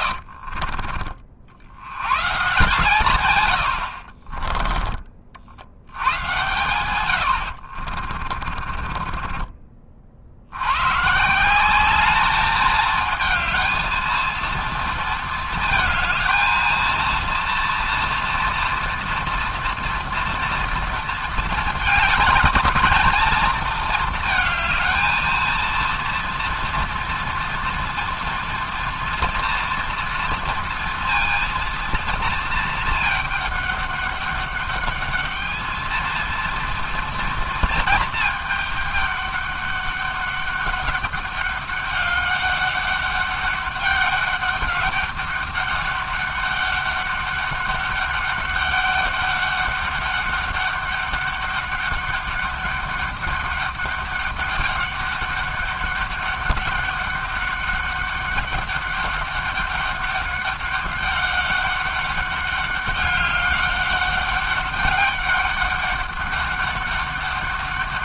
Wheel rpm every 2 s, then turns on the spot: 50, 140, 20, 130, 20, 80, 210, 230, 230, 230, 230, 220, 220, 230, 230, 230, 220, 200, 230, 210, 200, 200, 200, 200, 200, 200, 200, 200, 200, 200, 200, 200, 200, 200.
0-2 4-6 8-10